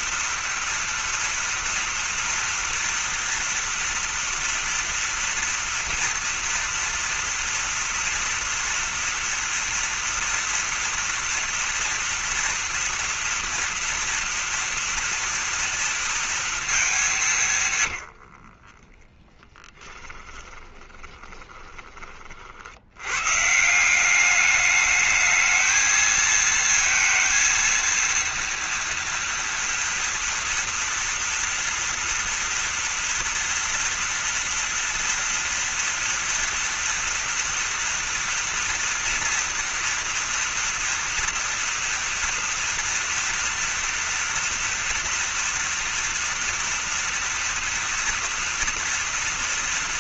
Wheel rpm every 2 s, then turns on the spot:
240, 230, 240, 230, 230, 230, 230, 230, 220, 40, 10, 80, 210, 230, 230, 230, 230, 230, 230, 230, 230, 230, 230, 230, 230.
18-22